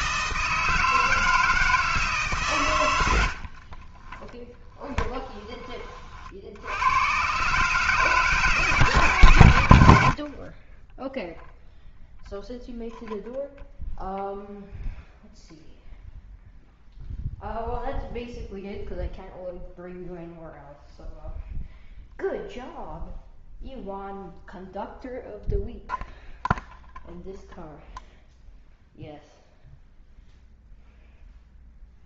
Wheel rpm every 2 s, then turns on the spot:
160, 150, 10, 60, 160, 40, 0, 0, 0, 0, 0, 0, 0, 0, 0, 0.
4-6